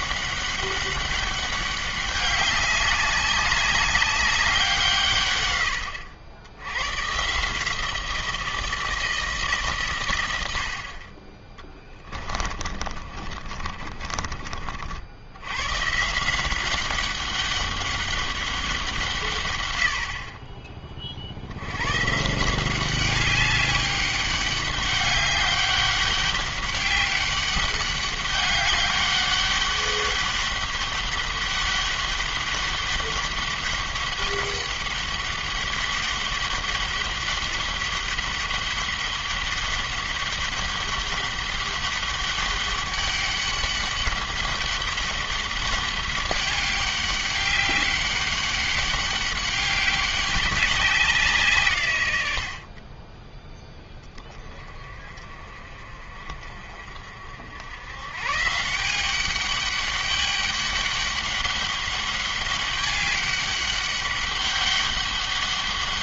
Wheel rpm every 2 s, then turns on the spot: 200, 200, 150, 120, 170, 40, 40, 70, 190, 160, 40, 190, 200, 200, 200, 200, 200, 200, 200, 200, 200, 200, 200, 200, 200, 190, 20, 30, 50, 180, 200, 200, 200.
12-14